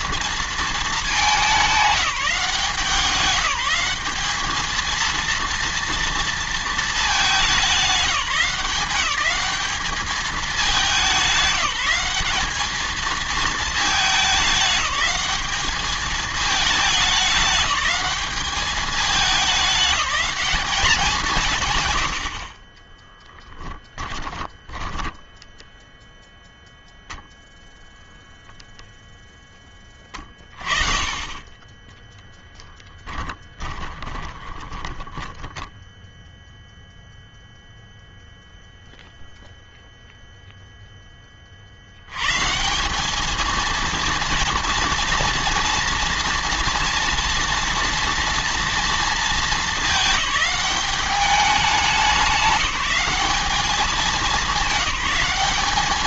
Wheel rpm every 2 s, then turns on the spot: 230, 180, 210, 230, 200, 200, 200, 210, 210, 210, 200, 60, 10, 0, 0, 30, 10, 10, 0, 0, 0, 140, 230, 230, 230, 210, 190, 210.
24-26 32-36